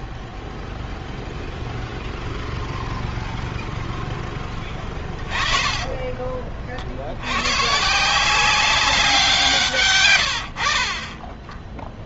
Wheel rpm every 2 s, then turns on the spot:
0, 0, 10, 40, 180, 80.
4-6